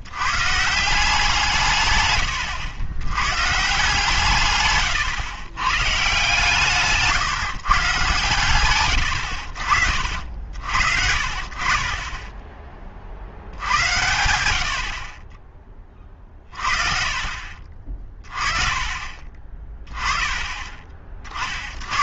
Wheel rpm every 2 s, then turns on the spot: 150, 100, 130, 150, 120, 60, 20, 80, 40, 30, 30.
none